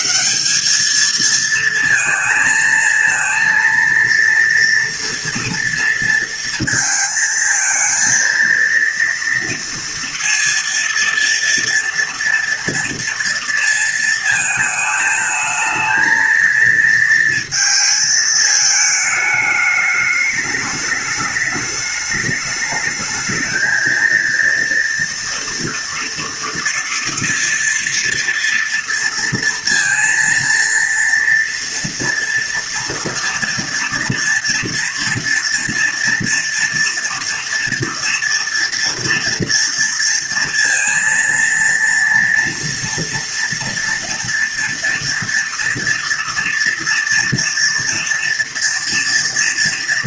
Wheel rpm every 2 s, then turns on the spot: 200, 220, 230, 230, 230, 230, 230, 220, 230, 220, 210, 210, 230, 240, 230, 230, 230, 230, 230, 230, 230, 230, 230, 230, 230.
none